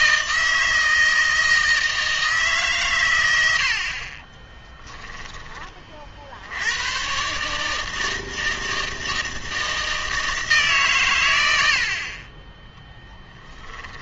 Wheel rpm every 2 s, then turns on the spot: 160, 140, 20, 100, 160, 130, 10.
4-6 12-14